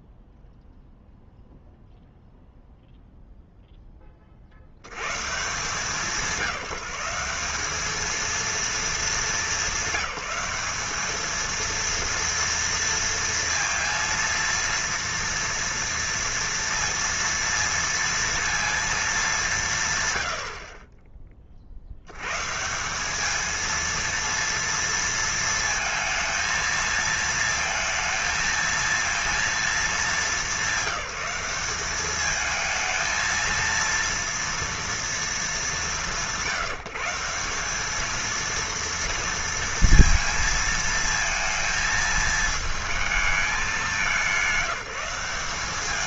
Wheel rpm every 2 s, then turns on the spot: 0, 0, 80, 180, 230, 200, 230, 230, 230, 230, 80, 160, 230, 230, 230, 200, 220, 230, 150, 230, 230, 220, 180.
none